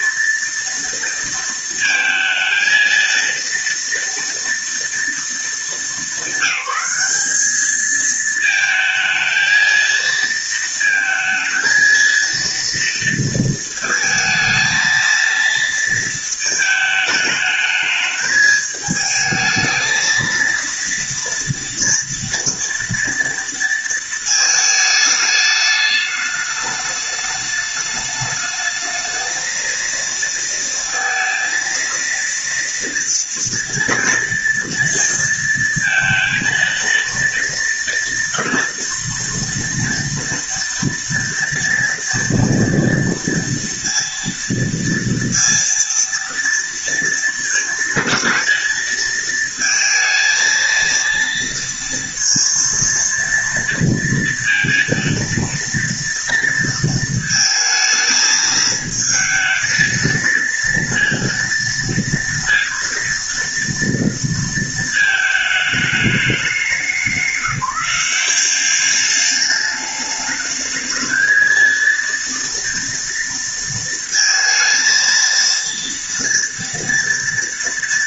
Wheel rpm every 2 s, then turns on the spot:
230, 230, 230, 200, 220, 230, 230, 230, 220, 220, 230, 230, 220, 210, 220, 230, 230, 230, 230, 230, 230, 230, 230, 230, 230, 220, 230, 230, 230, 220, 230, 230, 220, 180, 200, 220, 230, 230, 230.
none